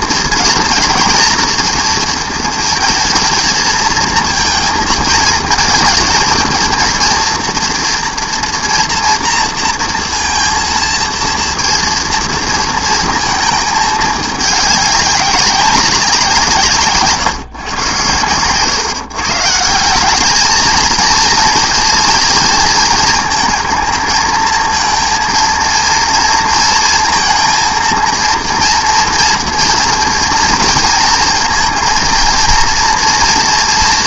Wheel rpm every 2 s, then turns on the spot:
220, 230, 230, 230, 230, 230, 230, 200, 150, 140, 220, 220, 230, 230, 230, 230, 230.
none